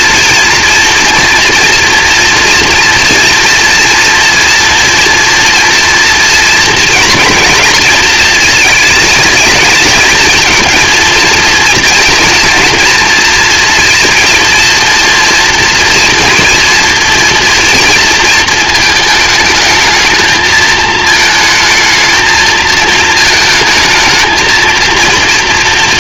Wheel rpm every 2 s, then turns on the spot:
230, 230, 240, 230, 220, 230, 230, 230, 230, 220, 220, 220, 230.
none